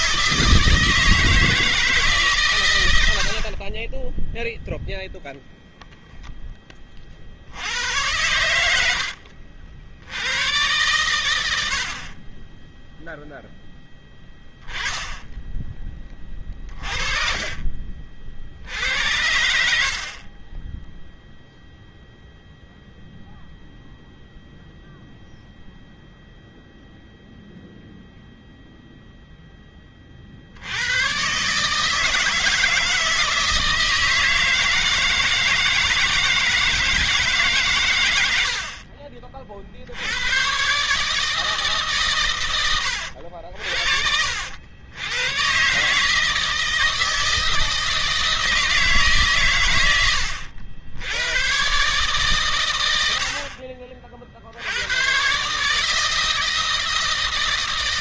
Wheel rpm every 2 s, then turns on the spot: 160, 100, 0, 30, 70, 110, 0, 10, 40, 70, 10, 0, 0, 0, 0, 100, 160, 160, 160, 50, 140, 80, 90, 160, 150, 90, 110, 90, 160.
8-10 14-18